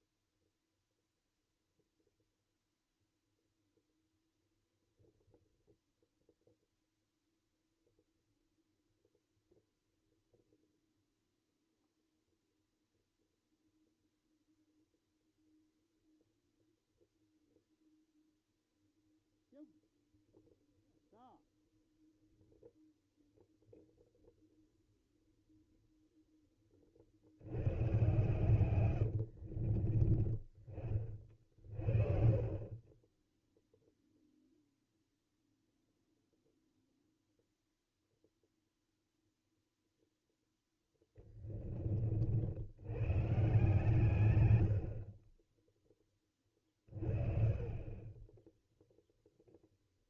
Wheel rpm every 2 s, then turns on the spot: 0, 0, 0, 0, 0, 0, 0, 0, 0, 0, 0, 0, 0, 20, 120, 20, 30, 0, 0, 0, 0, 80, 90, 30, 0.
none